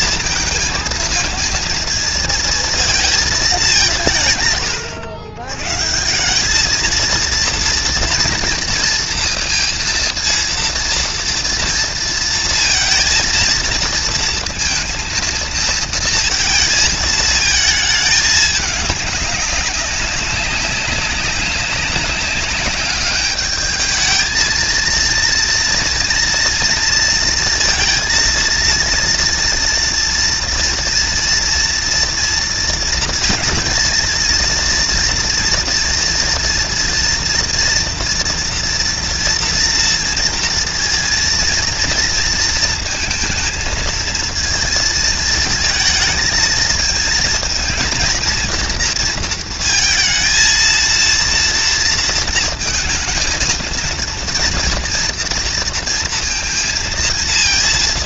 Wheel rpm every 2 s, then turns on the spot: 230, 220, 110, 230, 220, 230, 230, 230, 220, 200, 190, 200, 230, 240, 230, 230, 230, 230, 230, 230, 230, 220, 220, 220, 230, 230, 230, 230, 230.
none